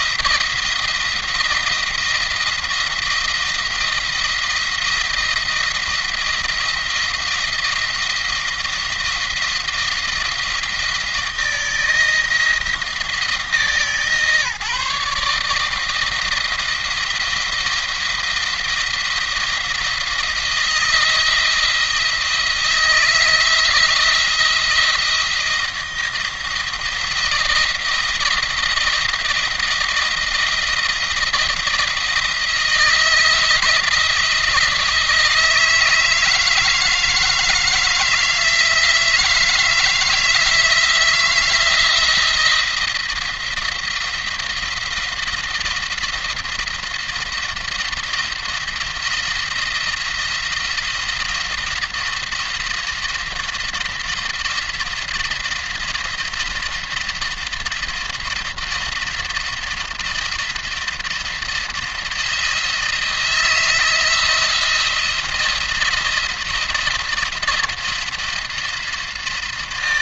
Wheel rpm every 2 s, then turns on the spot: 170, 170, 170, 170, 170, 170, 160, 150, 160, 170, 170, 160, 170, 170, 170, 170, 170, 160, 160, 160, 170, 170, 170, 170, 170, 170, 170, 170, 170, 170, 170, 170, 170, 170, 170.
none